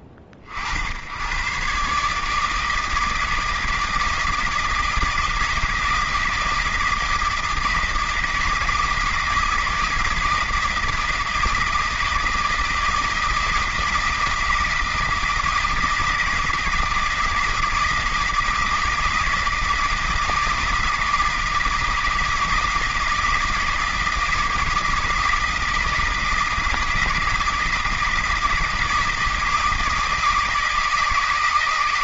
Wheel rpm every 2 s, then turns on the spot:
70, 160, 160, 160, 160, 160, 160, 160, 170, 160, 160, 160, 160, 160, 160, 160.
none